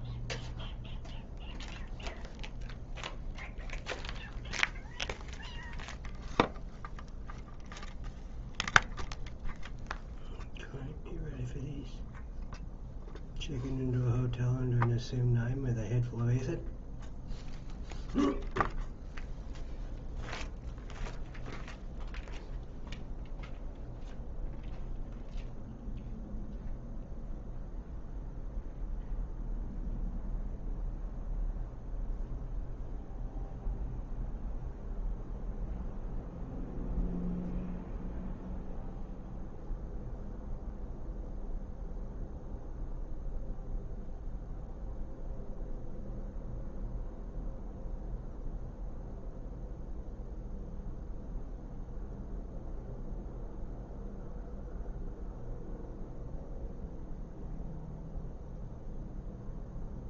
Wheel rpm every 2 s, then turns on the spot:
0, 0, 0, 0, 0, 0, 0, 0, 0, 0, 0, 0, 0, 0, 0, 0, 0, 0, 0, 0, 0, 0, 0, 0, 0, 0, 0, 0, 0, 0.
none